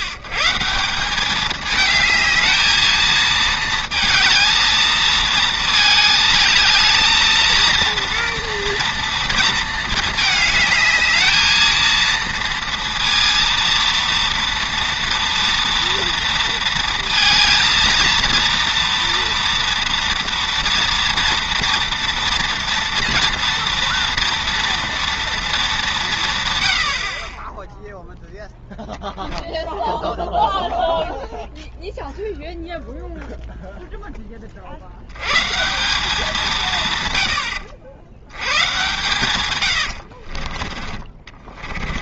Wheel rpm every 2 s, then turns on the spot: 160, 220, 220, 220, 240, 220, 230, 230, 220, 230, 230, 230, 230, 110, 0, 0, 0, 50, 170, 100, 40.
40-42